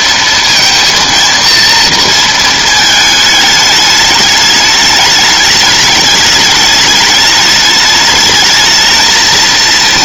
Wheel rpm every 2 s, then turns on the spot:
230, 220, 210, 210, 220.
none